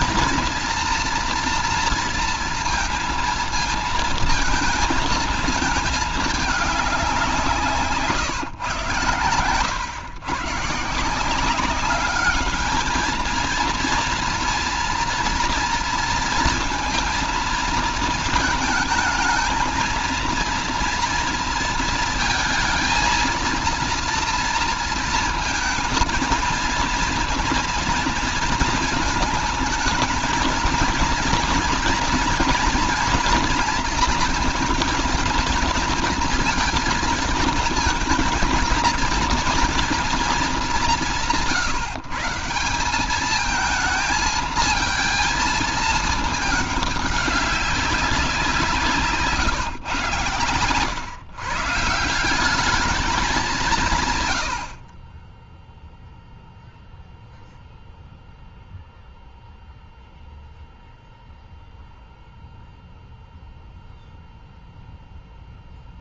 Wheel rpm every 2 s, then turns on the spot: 240, 230, 230, 210, 150, 130, 210, 230, 230, 220, 230, 220, 230, 230, 230, 220, 230, 220, 230, 220, 210, 170, 220, 210, 180, 120, 190, 90, 0, 0, 0, 0, 0.
none